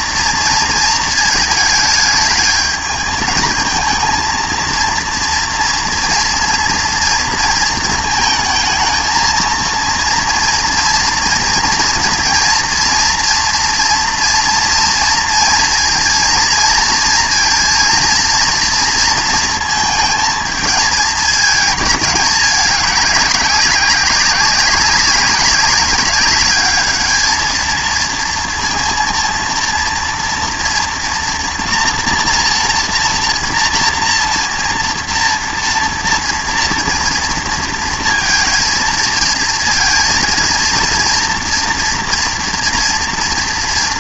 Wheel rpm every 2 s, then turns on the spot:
230, 220, 230, 230, 220, 230, 230, 230, 230, 230, 220, 200, 190, 210, 230, 230, 230, 230, 230, 230, 230, 240.
none